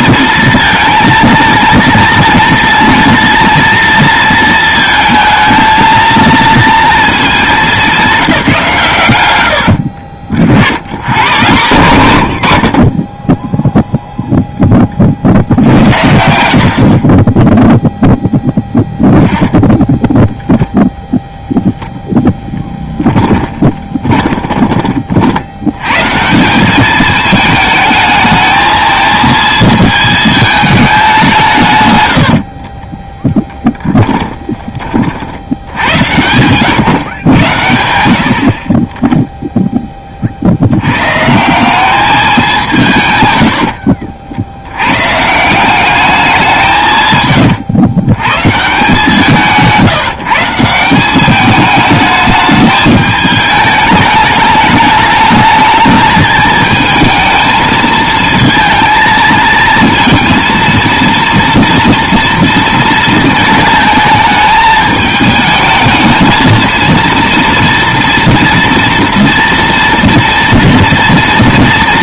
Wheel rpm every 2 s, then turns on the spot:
230, 230, 220, 230, 170, 70, 70, 20, 50, 0, 0, 0, 20, 200, 220, 210, 50, 40, 110, 40, 90, 160, 100, 170, 160, 170, 210, 210, 220, 230, 230, 230, 210, 230, 230, 230.
16-18 32-34